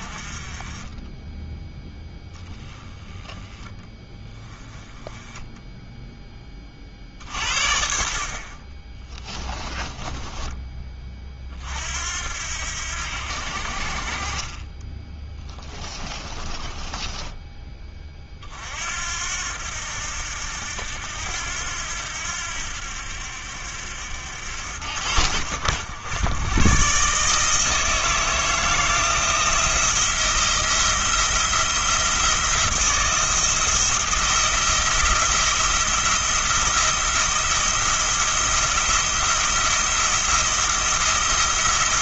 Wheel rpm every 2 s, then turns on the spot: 20, 10, 10, 30, 20, 20, 80, 20, 20, 60, 80, 70, 80, 120, 160, 170, 160, 170, 170, 170, 170.
16-18